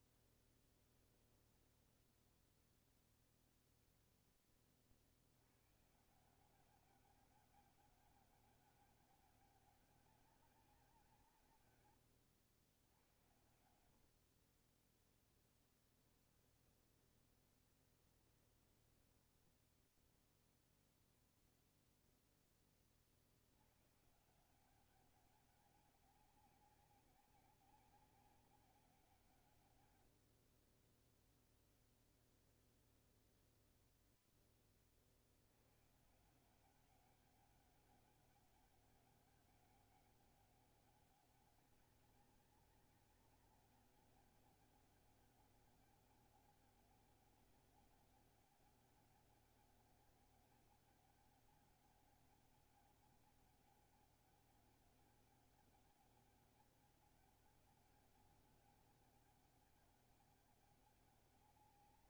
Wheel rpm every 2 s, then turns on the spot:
20, 10, 10, 160, 200, 200, 100, 60, 20, 20, 0, 10, 160, 190, 190, 60, 0, 10, 160, 200, 200, 190, 200, 200, 200, 200, 200, 190, 190, 190, 200.
0-2 14-20